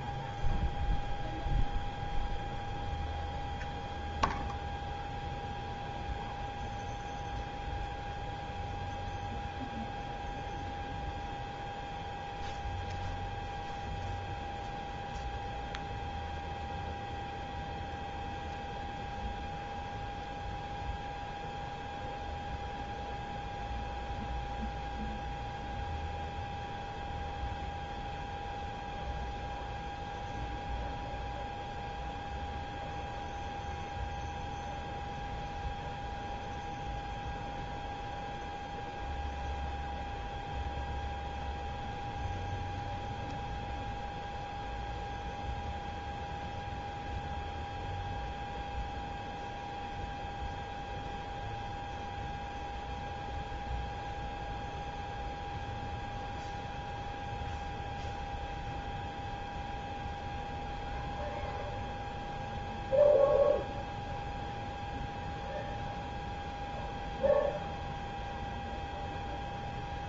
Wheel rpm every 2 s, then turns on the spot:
0, 0, 0, 0, 0, 0, 0, 0, 0, 0, 0, 0, 0, 0, 0, 0, 0, 0, 0, 0, 0, 0, 0, 0, 0, 0, 0, 0, 0, 0, 0, 0, 0, 0, 0.
none